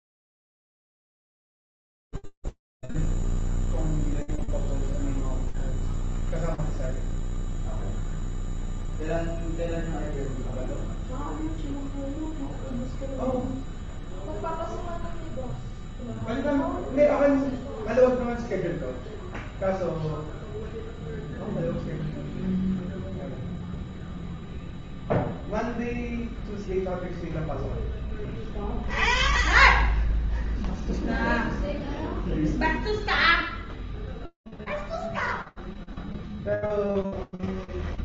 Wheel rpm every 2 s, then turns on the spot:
0, 0, 0, 0, 0, 0, 0, 0, 0, 0, 0, 0, 0, 0, 0, 20, 0, 0, 0.
30-32